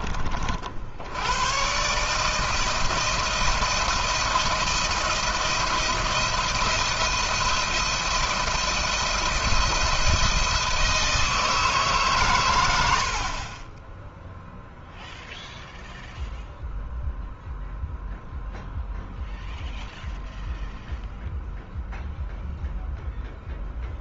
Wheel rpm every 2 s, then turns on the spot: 60, 160, 170, 170, 170, 160, 100, 0, 0, 0, 0, 0.
none